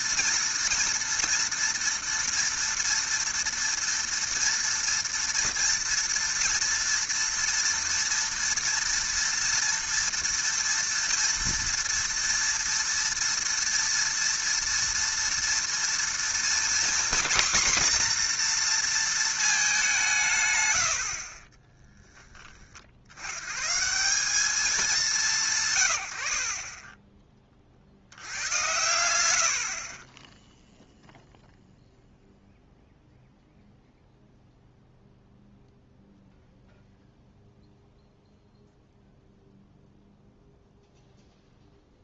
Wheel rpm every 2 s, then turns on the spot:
230, 230, 230, 230, 240, 240, 230, 230, 240, 240, 110, 30, 200, 40, 100, 0, 0, 0, 0, 0, 0.
none